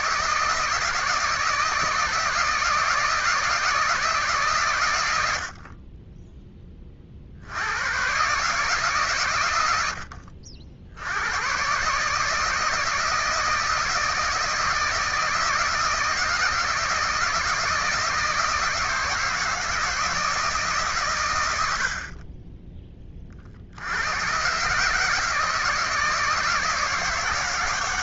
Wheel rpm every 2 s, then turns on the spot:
160, 160, 140, 10, 140, 60, 160, 160, 160, 160, 160, 40, 120, 160.
none